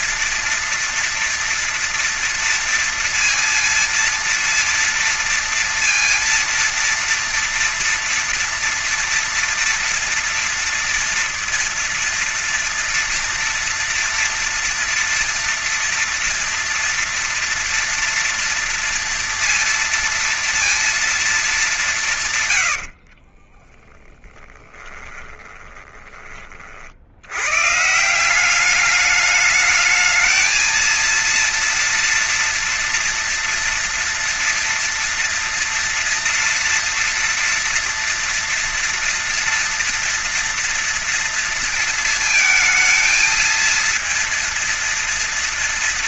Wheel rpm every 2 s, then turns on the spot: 230, 230, 230, 230, 230, 230, 230, 230, 230, 230, 230, 100, 20, 50, 190, 220, 230, 230, 230, 240, 230, 230, 230.
22-26